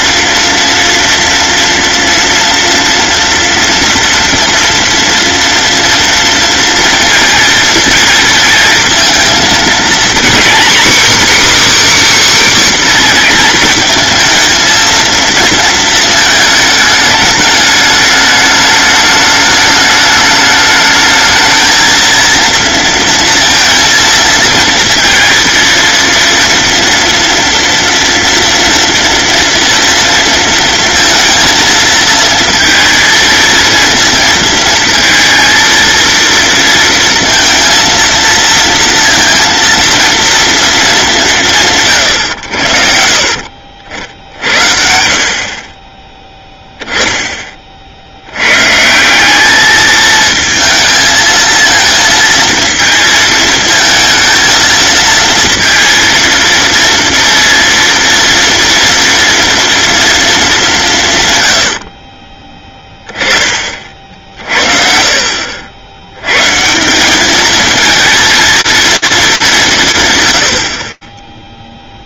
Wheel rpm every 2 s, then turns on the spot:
230, 230, 230, 230, 230, 270, 270, 230, 220, 210, 210, 230, 230, 230, 230, 230, 230, 220, 230, 230, 230, 80, 50, 10, 120, 220, 230, 220, 230, 230, 210, 20, 40, 160, 220, 50.
44-46